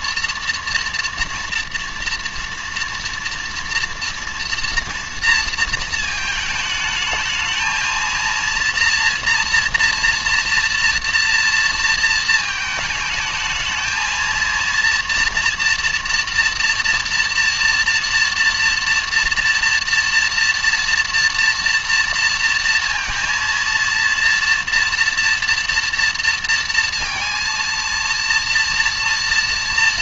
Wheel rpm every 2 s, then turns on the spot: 230, 230, 230, 220, 230, 230, 220, 230, 230, 230, 230, 230, 230, 230, 230.
none